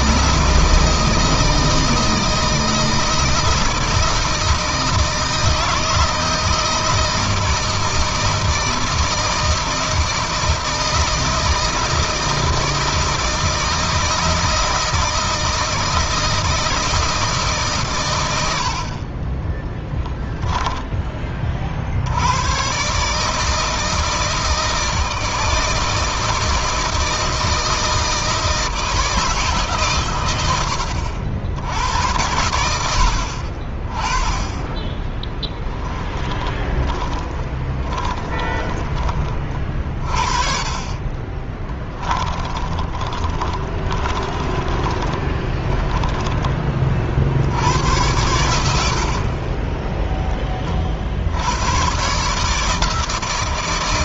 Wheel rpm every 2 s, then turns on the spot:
160, 160, 170, 160, 160, 160, 160, 160, 160, 60, 10, 120, 160, 160, 160, 100, 70, 10, 20, 20, 30, 10, 20, 20, 80, 30, 150.
36-40 42-46